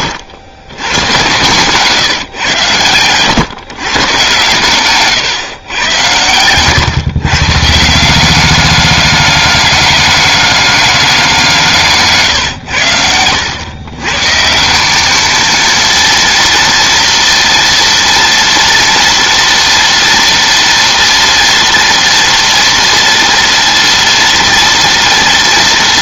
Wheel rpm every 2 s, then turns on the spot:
110, 120, 140, 130, 200, 190, 90, 210, 230, 230, 240, 230, 230.
none